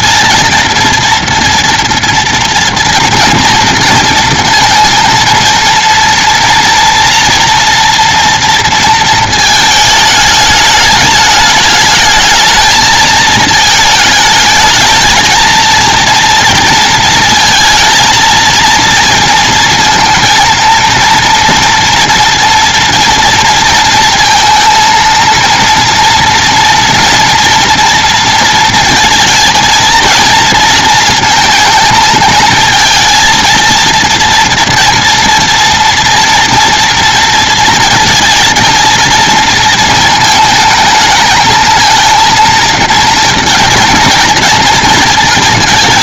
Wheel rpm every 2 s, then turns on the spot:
230, 230, 230, 230, 230, 210, 220, 220, 230, 230, 230, 230, 230, 240, 230, 230, 230, 230, 230, 230, 220, 230, 230.
none